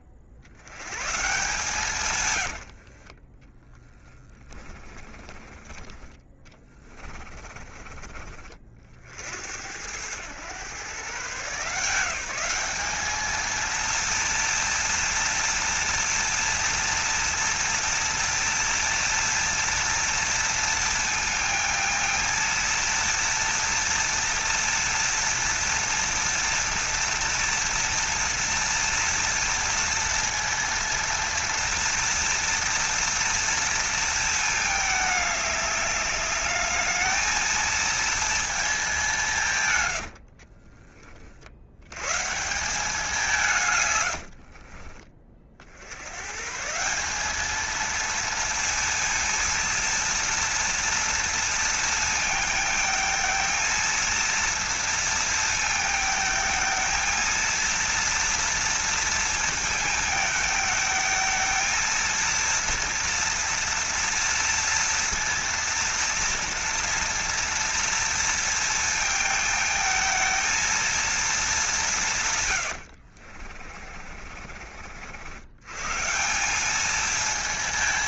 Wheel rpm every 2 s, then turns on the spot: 100, 70, 10, 20, 50, 120, 200, 230, 230, 230, 230, 230, 230, 230, 230, 230, 230, 220, 210, 210, 40, 180, 50, 160, 230, 230, 220, 230, 220, 230, 220, 230, 230, 230, 230, 230, 90, 60, 210.
2-8 40-42 44-46 72-74